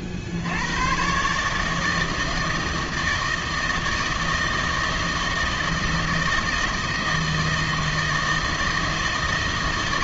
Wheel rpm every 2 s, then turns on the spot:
90, 160, 160, 160, 160.
none